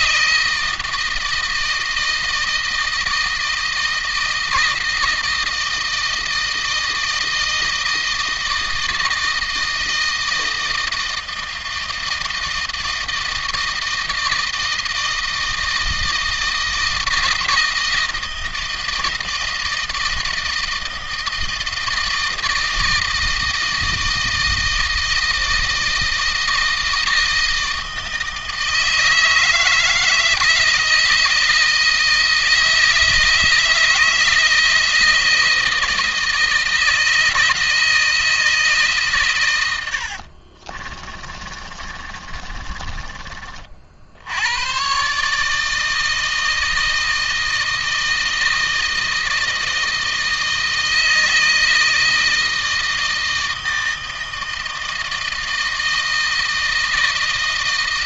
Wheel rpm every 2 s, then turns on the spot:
160, 160, 160, 160, 160, 160, 160, 160, 160, 160, 160, 160, 160, 160, 160, 160, 160, 160, 160, 140, 30, 30, 130, 160, 160, 160, 160, 160, 160.
40-44